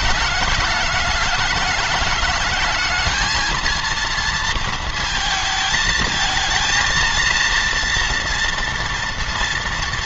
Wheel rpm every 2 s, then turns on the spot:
210, 220, 220, 230, 230.
none